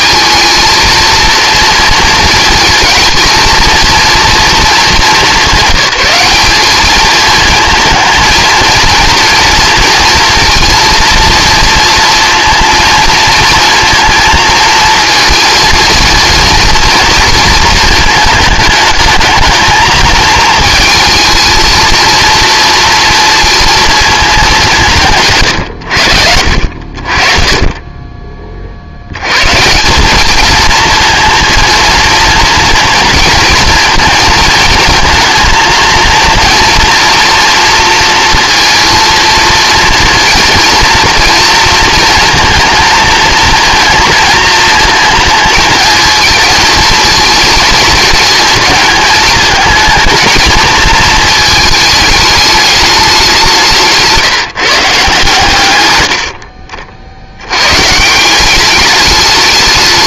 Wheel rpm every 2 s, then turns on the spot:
230, 230, 220, 210, 230, 230, 230, 230, 230, 210, 220, 230, 170, 60, 50, 230, 230, 220, 230, 230, 230, 230, 230, 230, 220, 230, 210, 150, 50, 200.
none